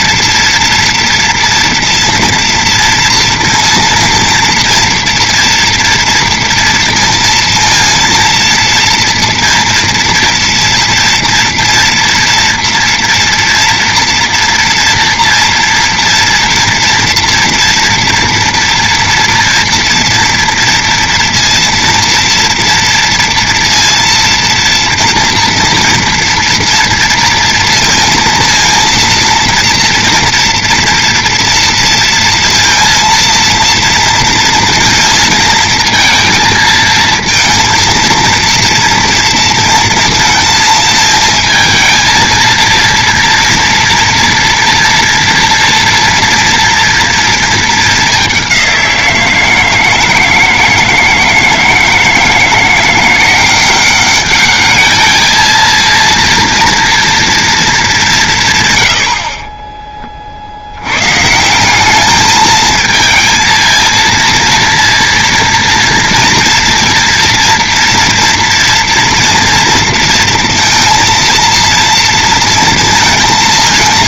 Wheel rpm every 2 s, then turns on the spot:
230, 230, 230, 230, 230, 230, 230, 230, 230, 230, 230, 230, 230, 230, 230, 230, 230, 230, 220, 230, 220, 230, 230, 230, 180, 160, 170, 210, 230, 120, 80, 220, 230, 230, 230, 230, 230.
none